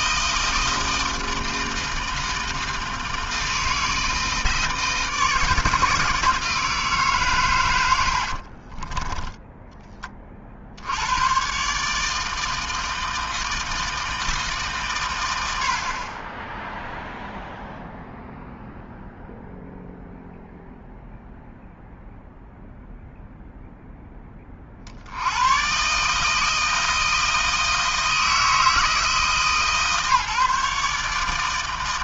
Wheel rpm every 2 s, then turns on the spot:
160, 160, 160, 150, 20, 100, 160, 130, 0, 0, 0, 0, 70, 160, 160, 150.
8-10